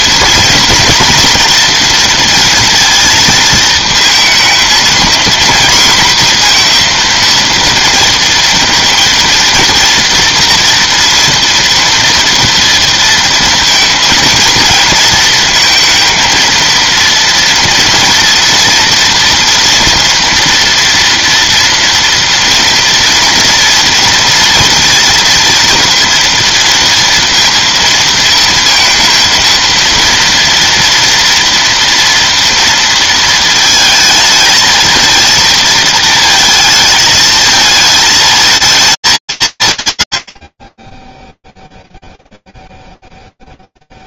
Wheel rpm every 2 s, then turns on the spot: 230, 230, 230, 230, 230, 230, 230, 230, 230, 230, 230, 230, 230, 230, 230, 230, 230, 220, 220, 220, 20, 0.
none